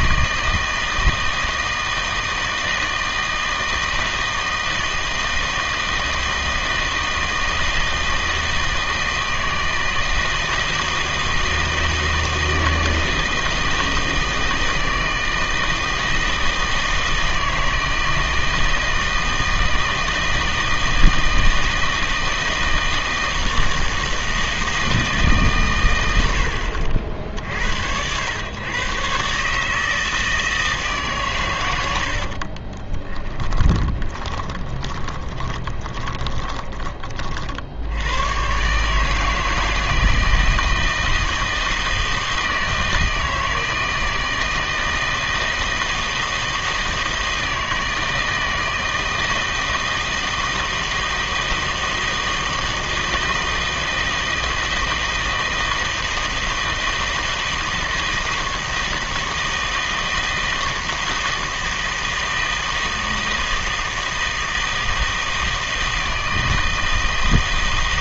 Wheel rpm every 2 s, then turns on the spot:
160, 160, 160, 160, 160, 160, 160, 160, 160, 160, 160, 160, 160, 80, 120, 160, 30, 20, 20, 130, 160, 160, 160, 160, 160, 160, 160, 160, 160, 160, 160, 160, 160, 160.
32-36